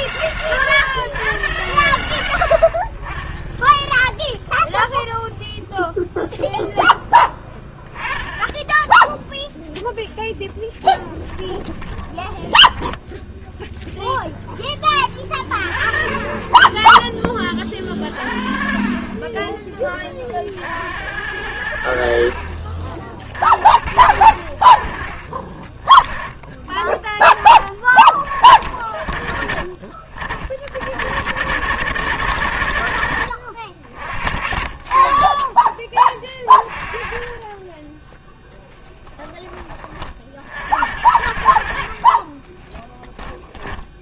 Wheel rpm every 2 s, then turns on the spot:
130, 90, 0, 0, 20, 0, 10, 10, 20, 50, 50, 60, 40, 20, 40, 60, 100, 50, 30, 10, 60, 20.
12-14 38-40 42-44